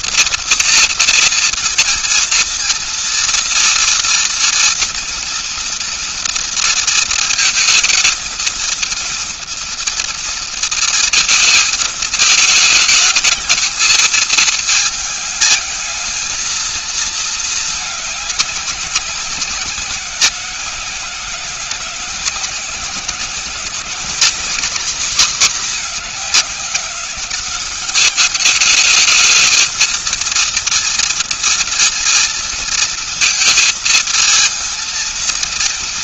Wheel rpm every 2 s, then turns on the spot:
230, 230, 230, 230, 220, 230, 220, 220, 230, 220, 180, 180, 220, 210, 210, 230, 230, 230.
none